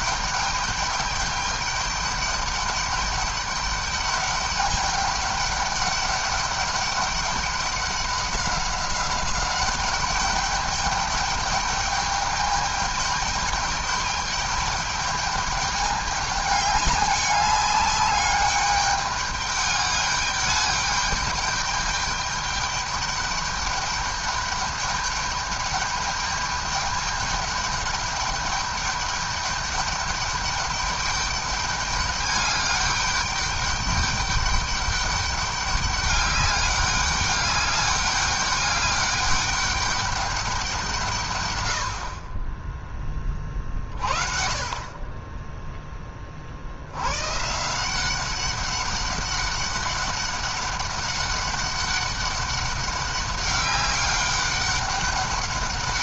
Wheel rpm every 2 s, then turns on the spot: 210, 200, 200, 200, 200, 210, 210, 210, 200, 200, 210, 210, 210, 200, 200, 200, 200, 200, 200, 200, 190, 30, 40, 60, 190, 200, 200, 200.
none